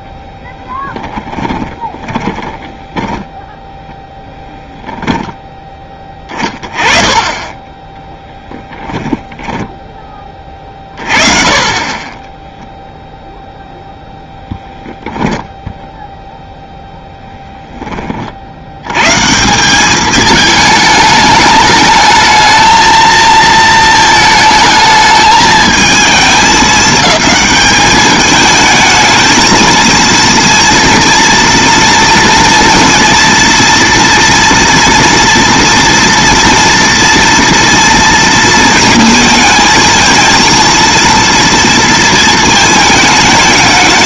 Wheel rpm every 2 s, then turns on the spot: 10, 20, 0, 20, 10, 30, 0, 0, 0, 90, 220, 220, 220, 210, 220, 230, 230, 230, 240, 230, 230, 220.
0-4 8-10